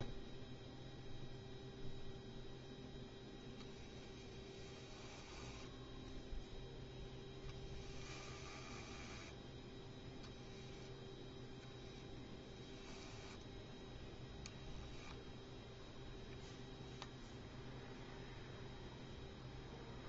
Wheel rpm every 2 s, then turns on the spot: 0, 10, 20, 10, 10, 0, 0, 0, 0, 0.
4-6 8-10